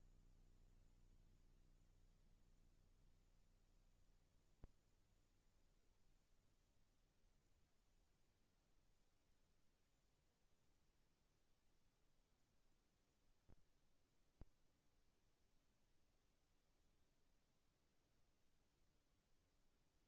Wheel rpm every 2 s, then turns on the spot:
0, 0, 0, 10, 20, 10, 0, 0, 0, 0.
none